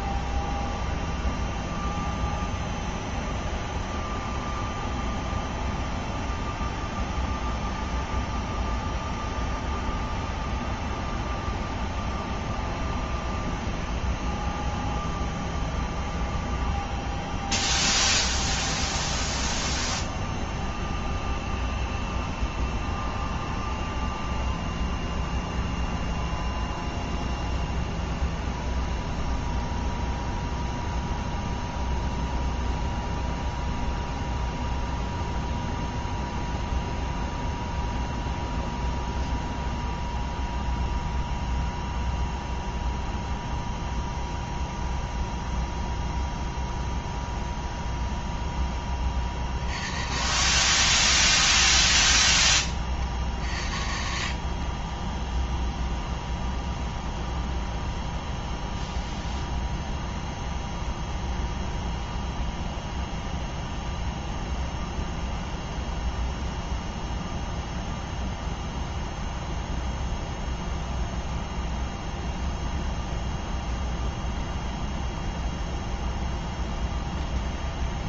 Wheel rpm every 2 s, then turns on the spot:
0, 0, 0, 0, 0, 0, 0, 0, 0, 0, 0, 0, 0, 0, 0, 0, 0, 0, 0, 0, 0, 0, 0, 0, 10, 120, 30, 40, 0, 0, 0, 0, 0, 0, 0, 0, 0, 0, 10.
54-56